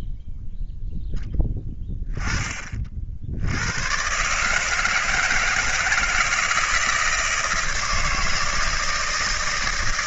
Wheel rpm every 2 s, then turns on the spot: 0, 50, 160, 160, 160.
none